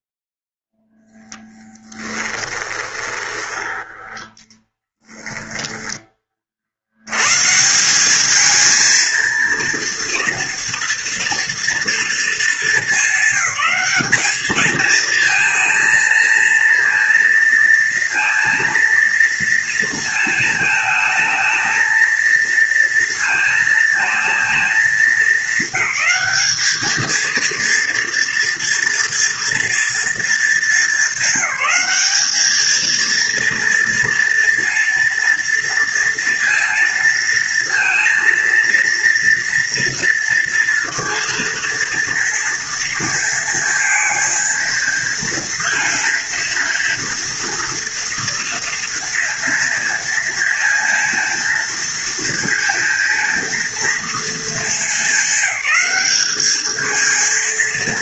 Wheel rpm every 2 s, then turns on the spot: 0, 20, 10, 110, 230, 230, 200, 220, 230, 230, 220, 230, 220, 220, 230, 200, 230, 230, 230, 230, 230, 230, 230, 230, 230, 230, 230, 210, 230.
2-6